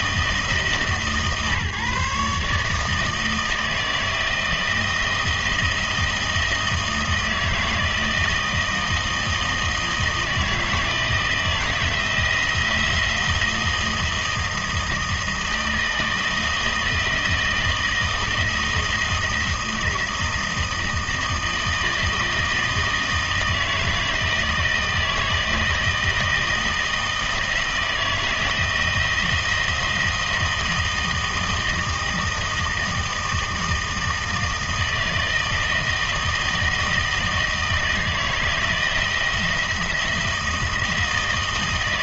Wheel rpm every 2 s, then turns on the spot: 150, 150, 160, 160, 160, 160, 170, 160, 160, 160, 160, 160, 160, 160, 160, 160, 160, 160, 160, 160, 160.
none